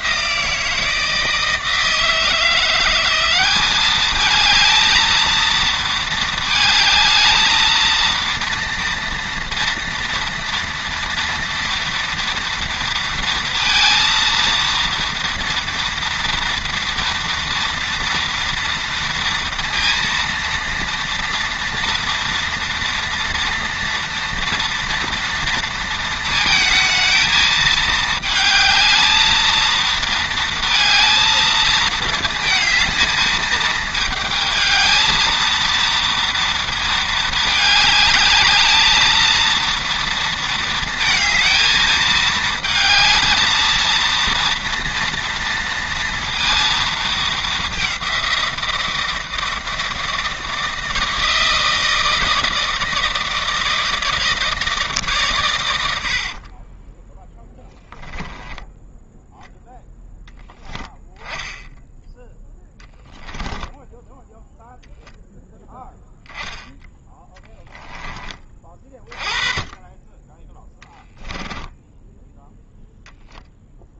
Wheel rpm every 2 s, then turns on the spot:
160, 180, 220, 220, 230, 230, 230, 230, 240, 230, 230, 230, 230, 220, 220, 220, 220, 220, 220, 220, 230, 220, 230, 220, 170, 160, 160, 150, 10, 10, 10, 10, 0, 10, 20, 10, 0.
56-58 62-64 70-72